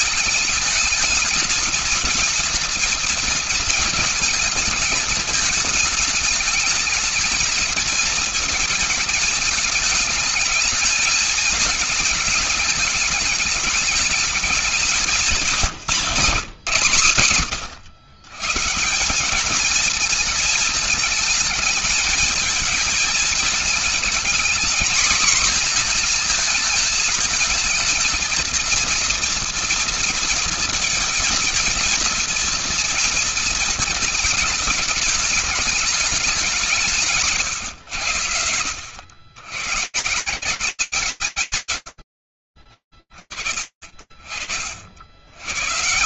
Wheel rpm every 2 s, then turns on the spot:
220, 230, 220, 220, 220, 220, 210, 210, 150, 160, 220, 220, 220, 220, 230, 230, 230, 220, 190, 100, 180, 30, 40.
none